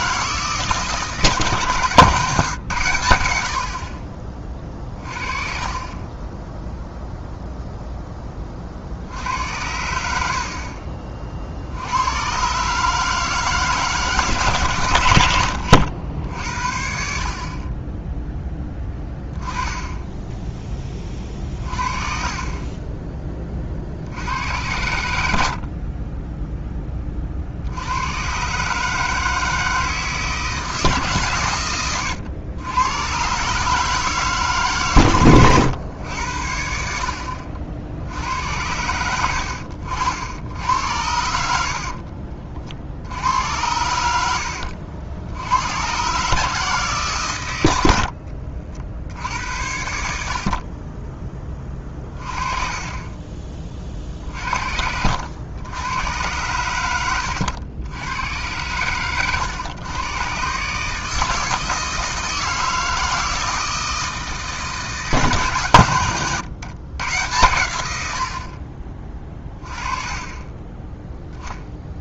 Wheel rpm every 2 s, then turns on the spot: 160, 130, 30, 0, 40, 50, 130, 120, 60, 10, 10, 20, 90, 10, 140, 160, 100, 140, 70, 90, 90, 60, 80, 150, 60, 40, 30, 60, 100, 110, 140, 160, 160, 130, 40, 20.
18-20 52-54 70-72